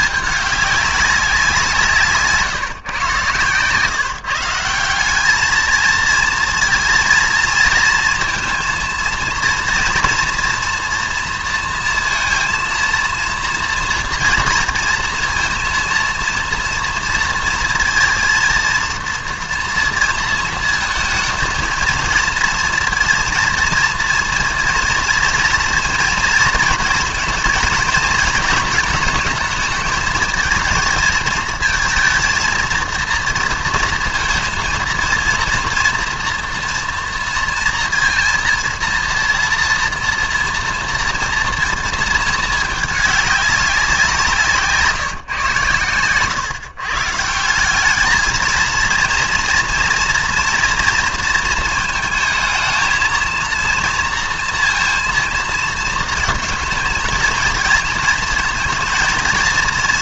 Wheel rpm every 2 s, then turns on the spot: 200, 140, 170, 230, 230, 240, 230, 240, 230, 230, 220, 230, 240, 230, 230, 230, 230, 230, 230, 230, 230, 210, 160, 130, 230, 230, 220, 230, 220, 230.
none